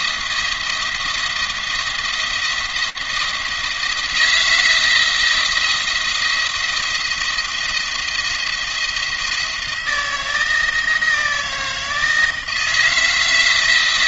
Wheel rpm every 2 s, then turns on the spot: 170, 170, 170, 170, 170, 160, 160.
none